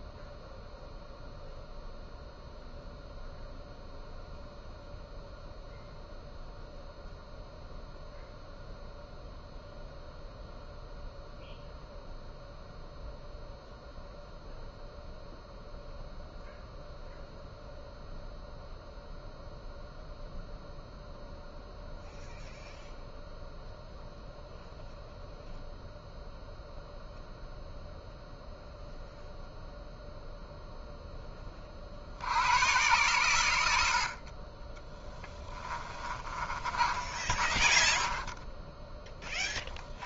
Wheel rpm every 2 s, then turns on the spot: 0, 0, 0, 0, 0, 0, 0, 0, 0, 0, 0, 0, 0, 0, 0, 0, 120, 10, 30, 20.
34-40